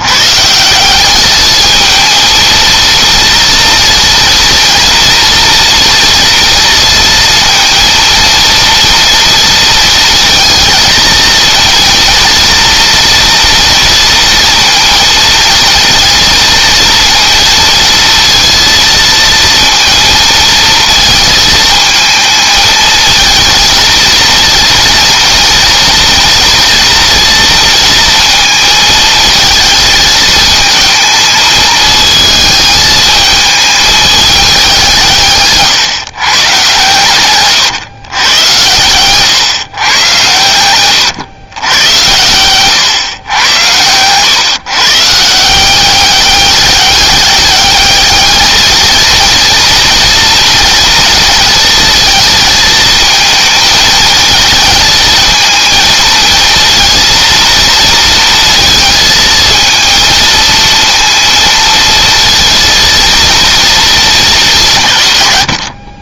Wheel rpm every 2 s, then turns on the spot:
160, 230, 230, 230, 230, 230, 230, 230, 230, 230, 220, 220, 230, 230, 220, 220, 220, 190, 130, 100, 110, 120, 140, 200, 220, 230, 220, 220, 230, 230, 230, 230, 150.
none